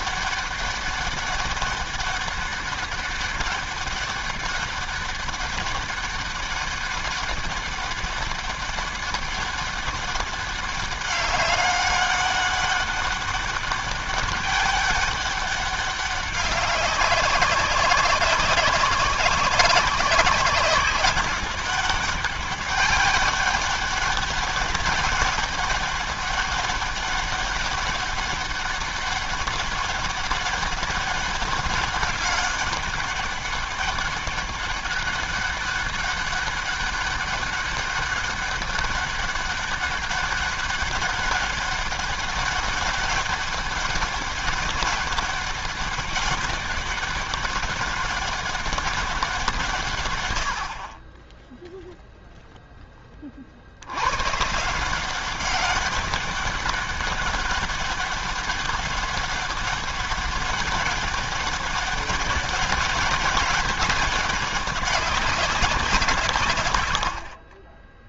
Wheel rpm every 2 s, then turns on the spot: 200, 200, 200, 200, 200, 200, 200, 200, 200, 190, 190, 200, 200, 200, 200, 200, 200, 200, 200, 200, 200, 200, 200, 200, 200, 50, 10, 150, 200, 200, 200, 200, 200, 100.
none